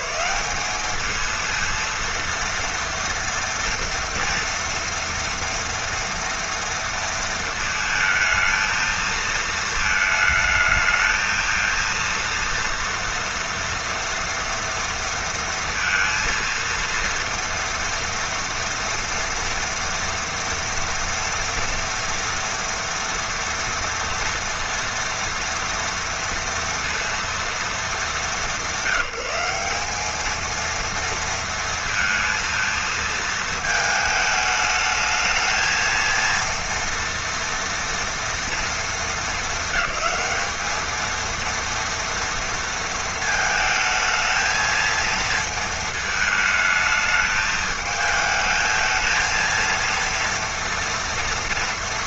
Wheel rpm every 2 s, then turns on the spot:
220, 230, 230, 230, 220, 220, 230, 230, 230, 230, 230, 240, 230, 230, 180, 230, 220, 220, 230, 220, 220, 220, 220, 220, 220, 230.
none